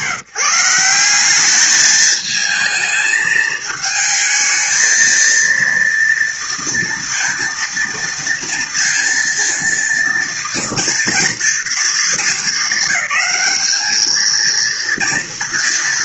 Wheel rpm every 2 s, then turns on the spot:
170, 220, 220, 230, 230, 240, 210, 230.
none